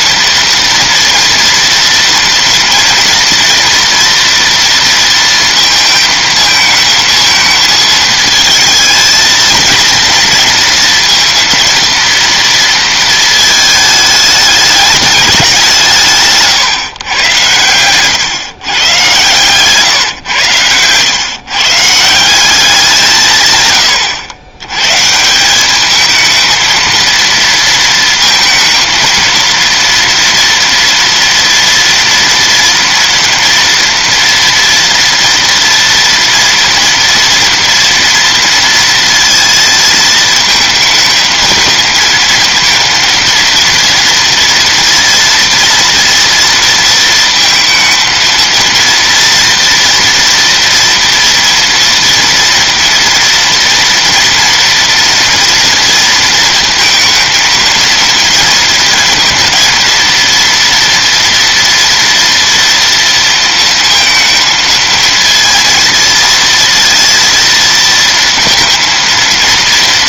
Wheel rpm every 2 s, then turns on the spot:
230, 230, 230, 220, 220, 230, 230, 210, 140, 130, 110, 190, 110, 220, 230, 230, 230, 230, 230, 230, 220, 230, 230, 230, 230, 230, 230, 230, 230, 230, 230, 230, 230, 230, 230.
none